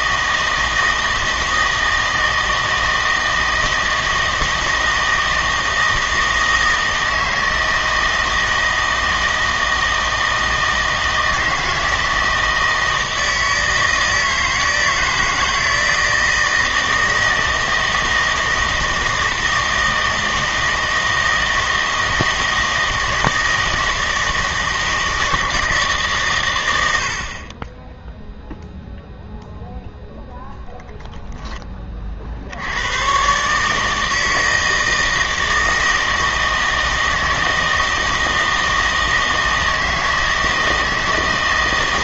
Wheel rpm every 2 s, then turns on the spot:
160, 160, 160, 160, 160, 160, 160, 160, 160, 160, 160, 160, 160, 100, 0, 0, 80, 160, 160, 160, 160.
none